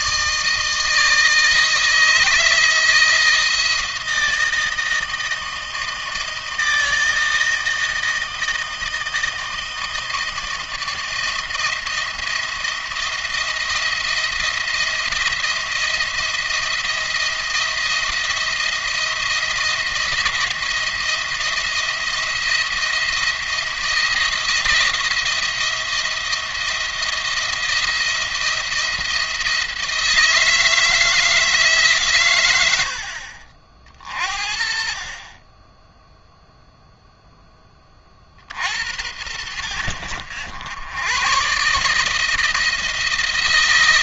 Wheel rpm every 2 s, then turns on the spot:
160, 160, 170, 160, 160, 160, 170, 170, 170, 170, 170, 170, 170, 170, 170, 160, 90, 50, 0, 70, 100, 160.
none